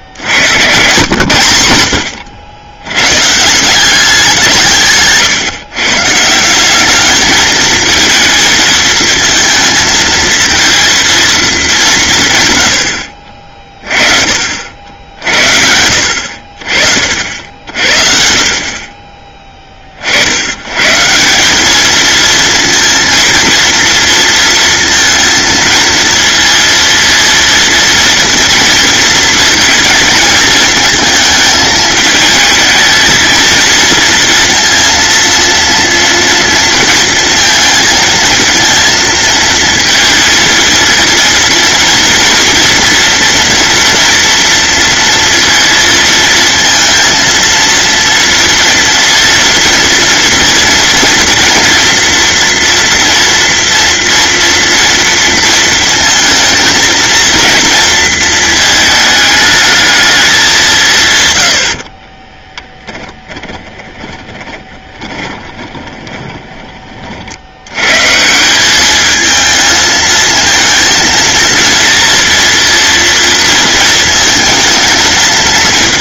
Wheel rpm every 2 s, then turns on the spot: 110, 100, 150, 200, 230, 230, 80, 70, 50, 30, 120, 230, 230, 230, 230, 220, 220, 230, 230, 230, 230, 240, 230, 230, 230, 230, 230, 230, 230, 220, 160, 10, 20, 30, 200, 230, 230, 230.
62-66